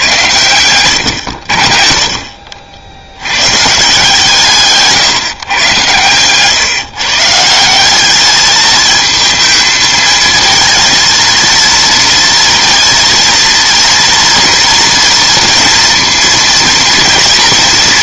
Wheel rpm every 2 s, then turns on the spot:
110, 60, 140, 130, 220, 230, 230, 230, 230.
none